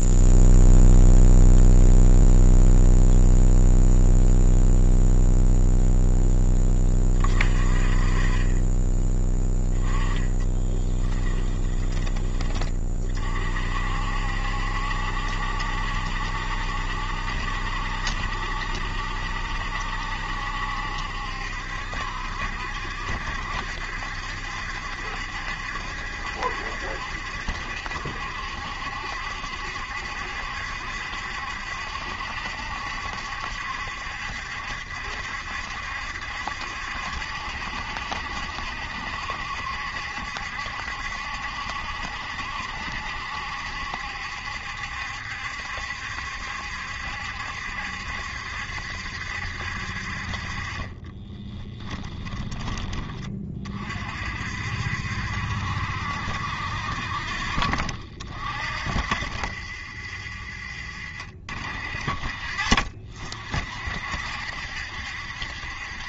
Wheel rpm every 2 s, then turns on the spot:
0, 0, 0, 20, 10, 20, 40, 70, 70, 70, 70, 70, 70, 70, 70, 70, 70, 70, 70, 70, 70, 70, 70, 70, 70, 20, 20, 60, 70, 50, 50, 50, 60.
10-12 50-52 60-62